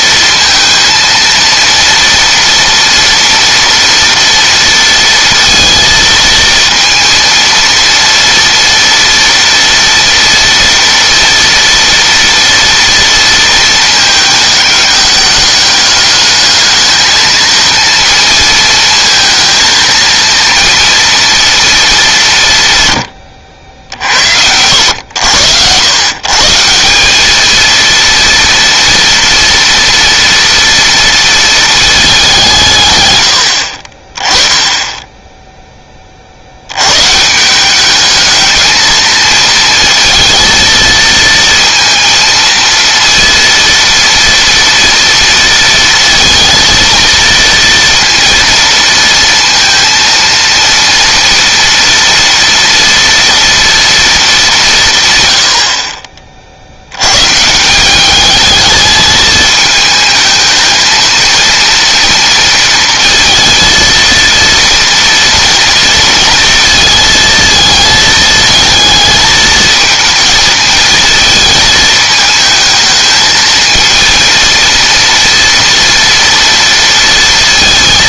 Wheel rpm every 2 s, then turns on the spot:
230, 230, 230, 230, 230, 230, 230, 210, 220, 230, 230, 110, 80, 190, 230, 230, 120, 10, 120, 220, 230, 230, 230, 230, 230, 230, 230, 140, 100, 220, 220, 230, 230, 220, 220, 220, 220, 230, 230.
none